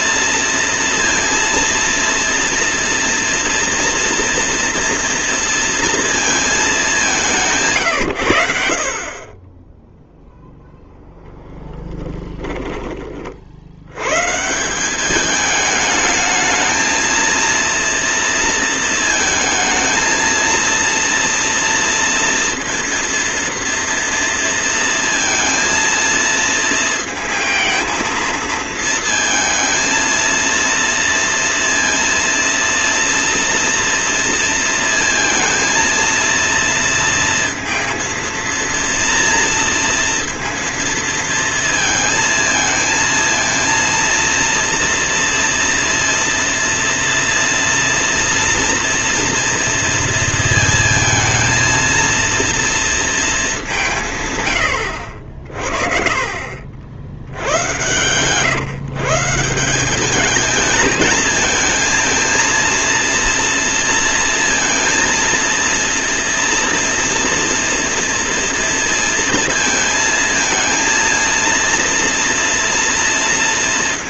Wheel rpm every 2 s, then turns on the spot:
230, 230, 230, 200, 60, 0, 20, 180, 220, 230, 230, 230, 230, 220, 230, 230, 230, 230, 230, 230, 230, 220, 230, 230, 230, 230, 230, 90, 60, 140, 220, 230, 230, 230, 230, 230, 230.
none